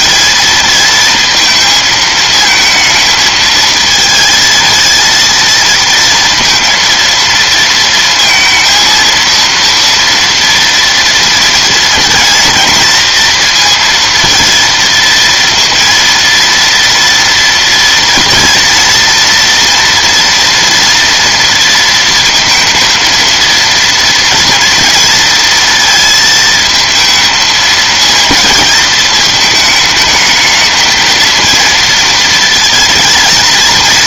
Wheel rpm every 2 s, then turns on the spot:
220, 220, 230, 230, 230, 230, 230, 230, 230, 230, 230, 230, 230, 220, 230, 220, 230.
none